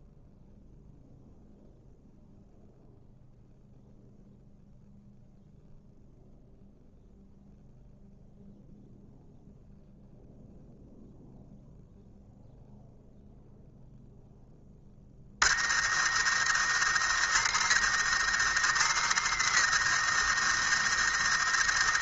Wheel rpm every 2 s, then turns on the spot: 0, 0, 0, 0, 0, 0, 0, 10, 110, 110, 110.
none